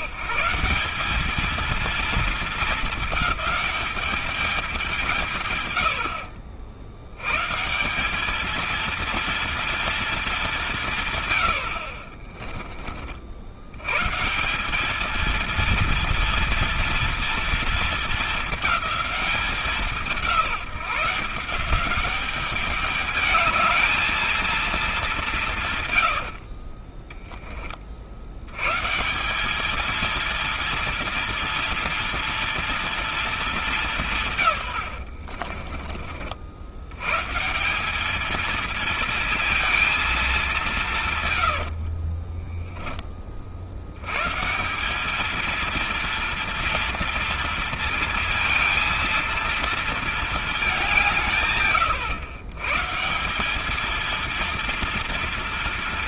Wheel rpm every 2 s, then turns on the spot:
180, 220, 190, 80, 220, 170, 30, 200, 230, 210, 170, 210, 210, 30, 130, 230, 230, 110, 80, 230, 180, 10, 200, 230, 230, 190, 150, 230.
26-28 34-36